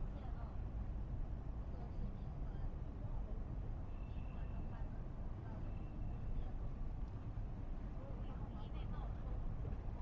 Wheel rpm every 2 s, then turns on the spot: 0, 0, 0, 0, 0.
none